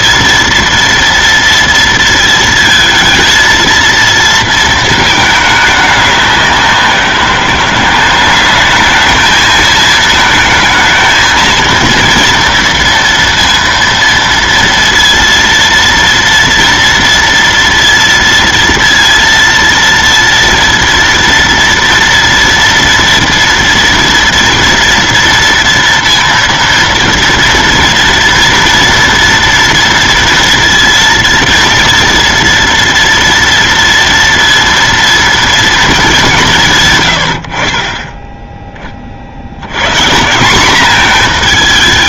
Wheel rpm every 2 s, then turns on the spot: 230, 220, 220, 190, 210, 220, 230, 230, 230, 230, 230, 230, 240, 230, 230, 230, 230, 230, 150, 20, 200.
none